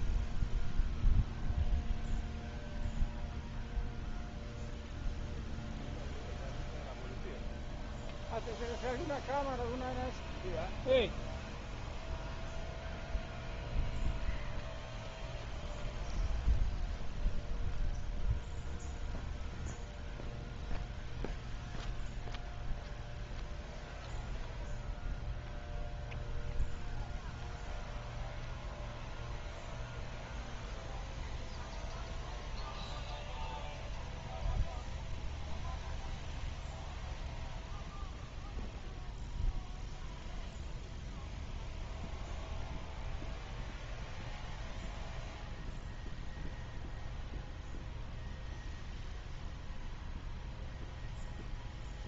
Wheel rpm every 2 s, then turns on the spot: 0, 0, 0, 0, 0, 0, 0, 0, 0, 0, 0, 0, 0, 0, 0, 0, 0, 0, 0, 0, 0, 0, 0, 0, 0, 0.
none